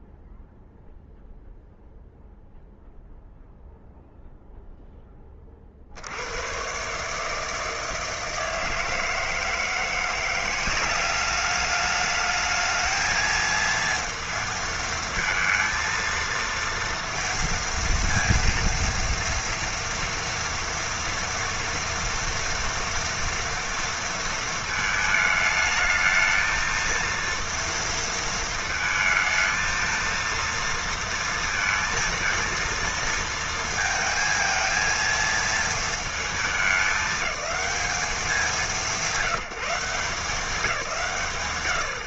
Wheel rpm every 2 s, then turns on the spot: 0, 0, 10, 140, 160, 190, 220, 230, 230, 230, 230, 230, 220, 230, 220, 230, 230, 230, 210, 150, 160.
none